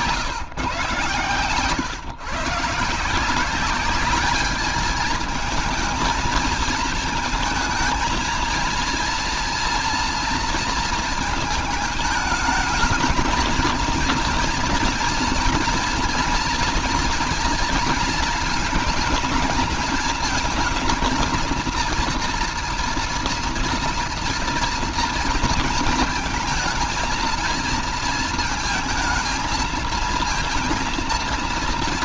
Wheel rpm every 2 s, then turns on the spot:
140, 140, 210, 220, 230, 230, 220, 230, 240, 230, 230, 230, 230, 220, 230, 230.
none